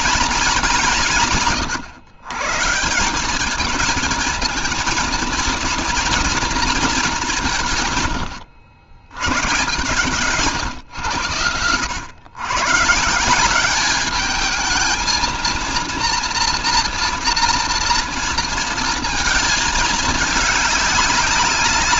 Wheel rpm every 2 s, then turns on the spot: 180, 160, 220, 210, 110, 110, 140, 220, 230, 230, 200.
none